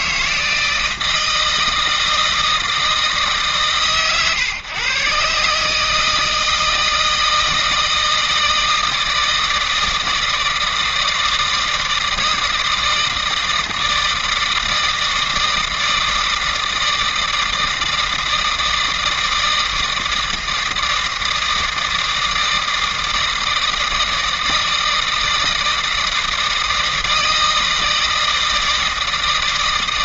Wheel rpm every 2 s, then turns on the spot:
160, 160, 130, 160, 160, 160, 160, 160, 160, 160, 160, 160, 160, 160, 160.
none